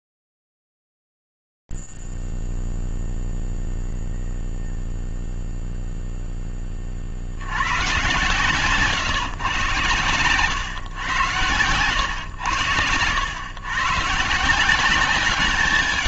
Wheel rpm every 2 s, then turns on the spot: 0, 0, 0, 0, 110, 120, 110, 130.
none